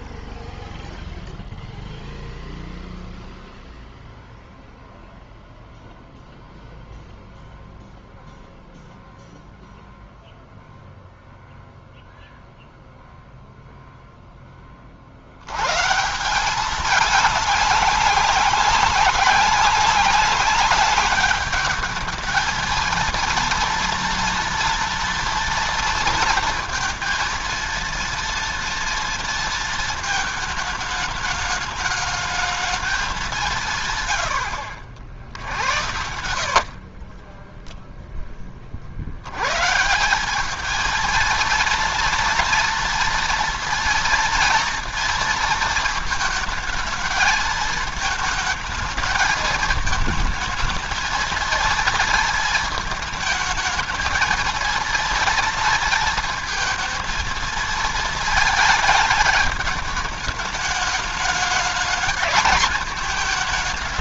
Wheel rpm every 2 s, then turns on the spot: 0, 0, 0, 0, 0, 0, 0, 20, 190, 190, 210, 220, 230, 230, 230, 220, 220, 80, 60, 30, 210, 230, 230, 220, 220, 220, 220, 230, 230, 220, 220, 210.
36-38